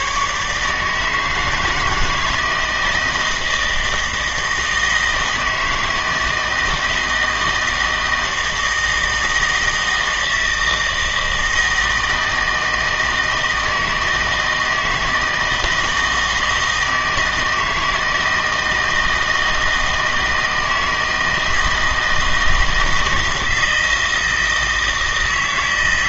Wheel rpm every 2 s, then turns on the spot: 150, 160, 160, 160, 160, 160, 160, 160, 160, 160, 160, 160, 160.
none